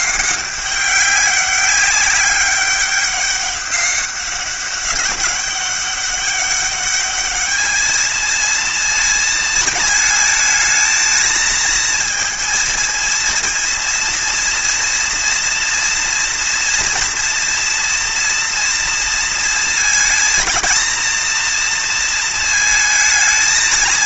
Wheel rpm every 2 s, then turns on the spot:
190, 200, 200, 200, 230, 220, 230, 230, 230, 230, 230, 220.
none